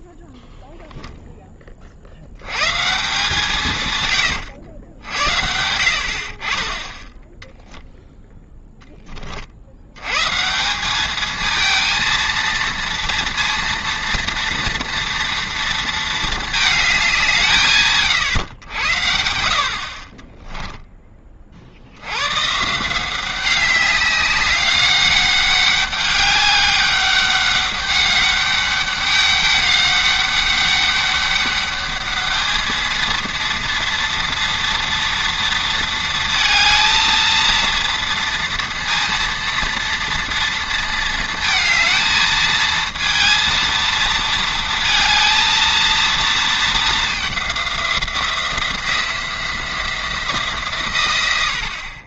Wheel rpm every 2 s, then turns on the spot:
0, 130, 90, 20, 10, 180, 230, 230, 220, 90, 10, 150, 200, 200, 200, 200, 220, 230, 220, 230, 230, 220, 230, 220, 170, 140.
none